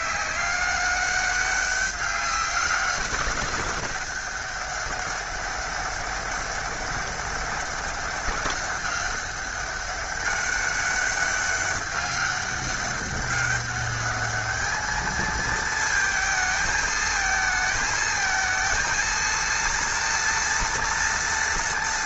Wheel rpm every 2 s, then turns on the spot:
200, 200, 200, 200, 200, 200, 200, 210, 220, 230, 230.
none